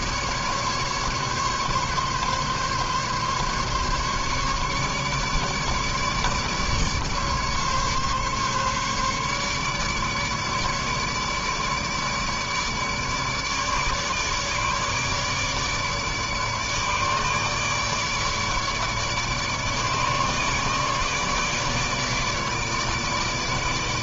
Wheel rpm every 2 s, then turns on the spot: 150, 140, 150, 150, 140, 150, 150, 150, 150, 150, 150, 150.
none